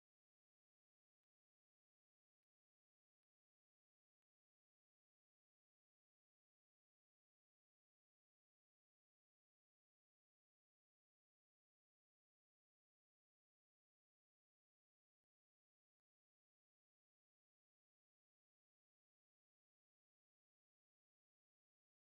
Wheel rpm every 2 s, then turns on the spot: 0, 0, 0, 0, 0, 0, 0, 0, 0, 0, 0.
none